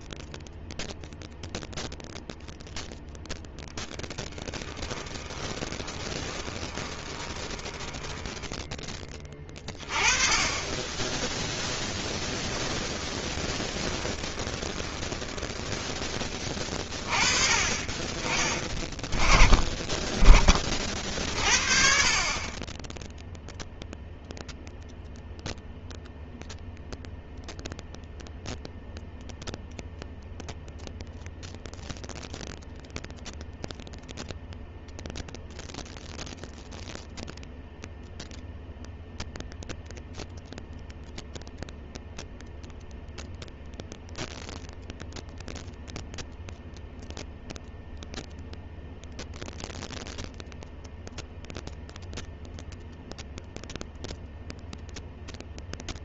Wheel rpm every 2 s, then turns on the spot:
0, 10, 20, 10, 20, 10, 20, 10, 20, 20, 50, 0, 0, 0, 0, 0, 0, 0, 0, 0, 0, 0, 0, 0, 0, 0, 0, 0.
2-8 10-16